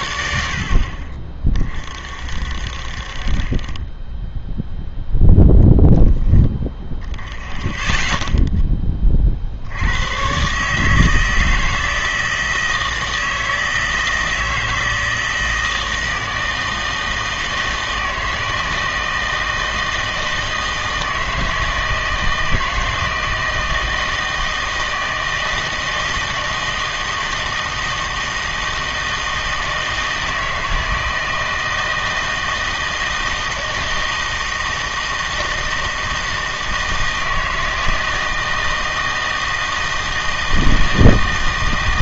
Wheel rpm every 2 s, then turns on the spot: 70, 50, 0, 10, 10, 140, 160, 160, 160, 160, 160, 160, 160, 160, 160, 160, 160, 160, 160, 160, 160.
none